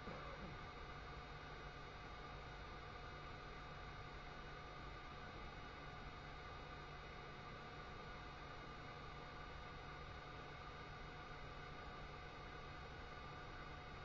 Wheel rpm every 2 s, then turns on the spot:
0, 0, 0, 0, 0, 0, 0.
none